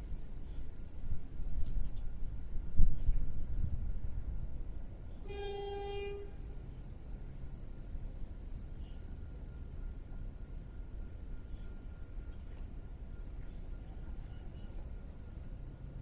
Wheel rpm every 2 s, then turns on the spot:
0, 0, 0, 0, 0, 0, 0, 0.
none